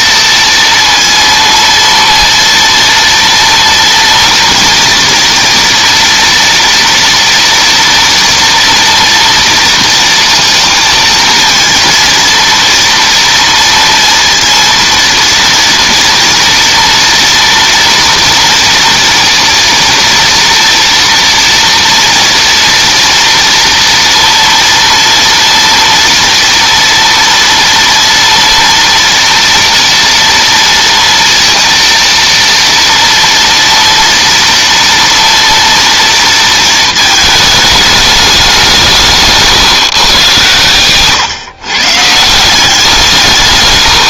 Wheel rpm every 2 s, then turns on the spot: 230, 230, 230, 230, 230, 230, 230, 230, 230, 240, 230, 230, 230, 230, 230, 230, 230, 230, 220, 160, 120, 180.
none